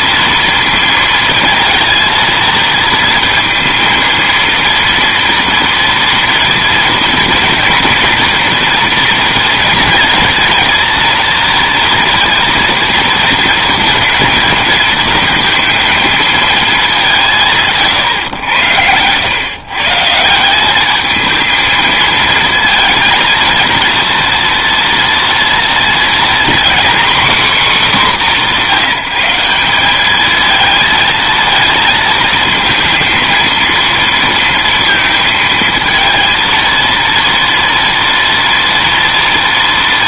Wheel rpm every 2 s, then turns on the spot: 230, 220, 230, 230, 240, 230, 230, 230, 220, 100, 190, 230, 230, 240, 210, 220, 220, 230, 230, 230.
none